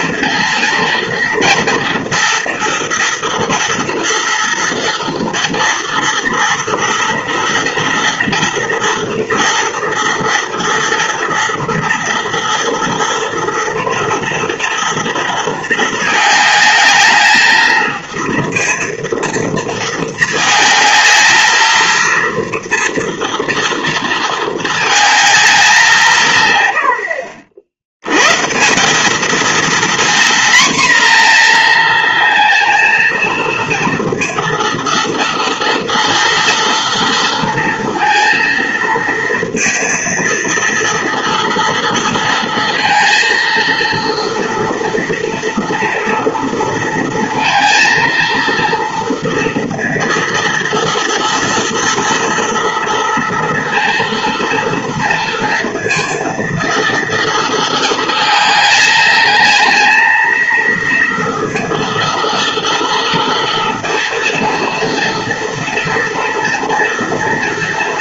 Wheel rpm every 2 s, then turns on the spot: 230, 230, 230, 230, 230, 230, 230, 230, 220, 230, 220, 230, 220, 100, 170, 240, 230, 230, 230, 230, 230, 230, 240, 230, 230, 230, 230, 230, 230, 220, 230, 230, 230, 240.
none